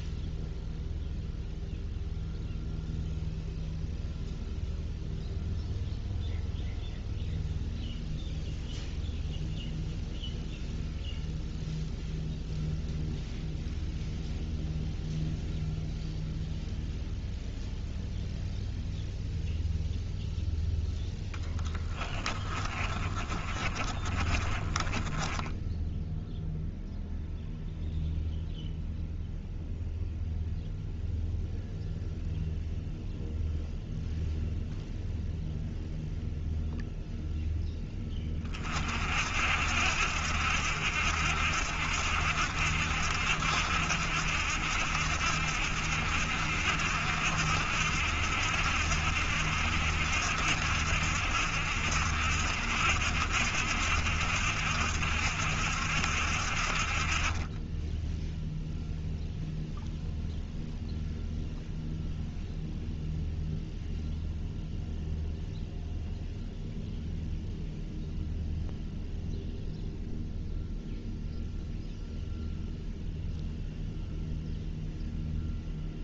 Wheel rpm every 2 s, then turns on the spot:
0, 0, 0, 0, 0, 0, 0, 0, 0, 0, 0, 30, 30, 0, 0, 0, 0, 0, 0, 30, 70, 70, 70, 70, 70, 70, 70, 70, 50, 0, 0, 0, 0, 0, 0, 0, 0, 0.
22-26